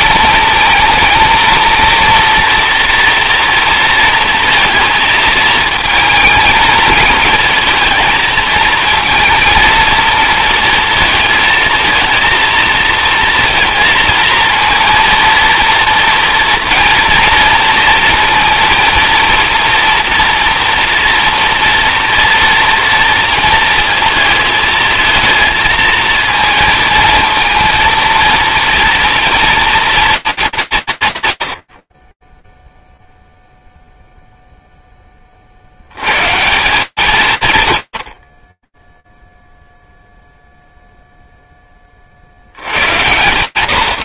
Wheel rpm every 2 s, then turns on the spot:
220, 240, 230, 220, 220, 230, 230, 230, 230, 230, 230, 230, 220, 220, 230, 210, 10, 0, 160, 10, 0, 100.
none